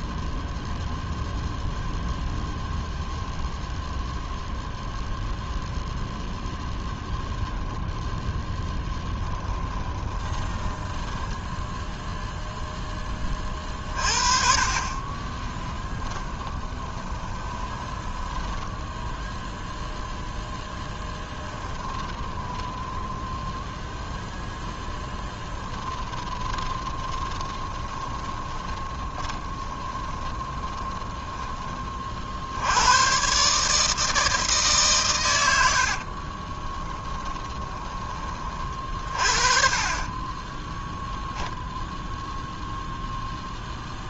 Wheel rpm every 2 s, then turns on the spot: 0, 0, 0, 10, 10, 10, 10, 30, 20, 10, 10, 20, 0, 20, 20, 10, 100, 140, 20, 40, 10, 0.
8-12 16-24 26-32 36-38